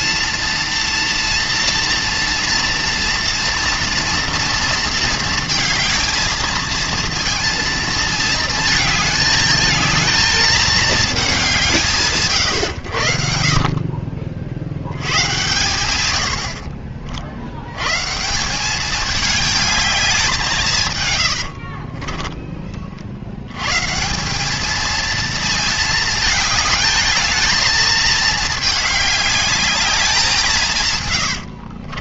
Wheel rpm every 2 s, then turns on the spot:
230, 240, 230, 220, 220, 220, 90, 70, 50, 200, 150, 40, 220, 220, 210, 140.
16-18